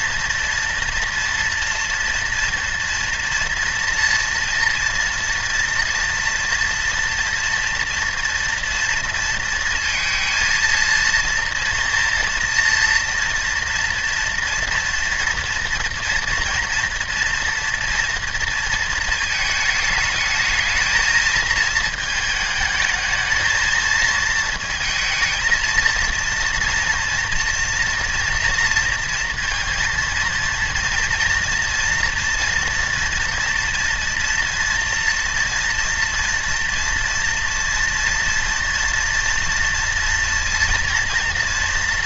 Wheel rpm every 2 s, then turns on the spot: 240, 230, 230, 240, 230, 230, 230, 230, 230, 230, 220, 220, 220, 240, 230, 230, 240, 230, 230, 230, 230.
none